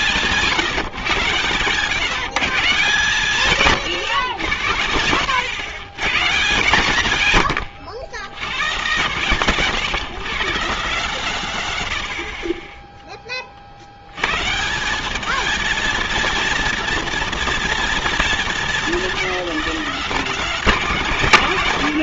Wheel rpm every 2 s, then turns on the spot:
150, 150, 120, 150, 120, 150, 30, 150, 220, 190, 200.
none